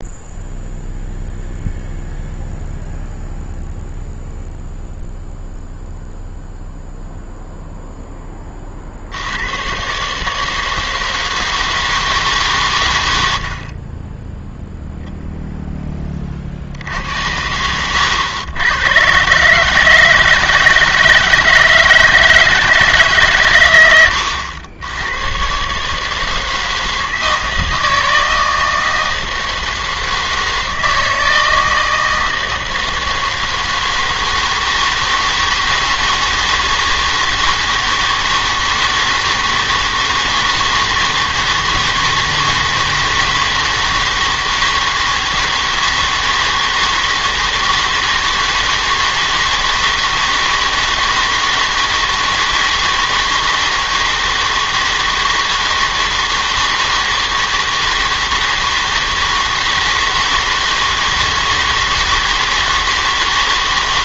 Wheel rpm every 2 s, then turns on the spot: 0, 0, 0, 0, 30, 160, 140, 0, 50, 100, 160, 160, 90, 160, 160, 160, 160, 160, 160, 160, 160, 160, 160, 160, 160, 160, 160, 160, 160, 160, 160, 160.
none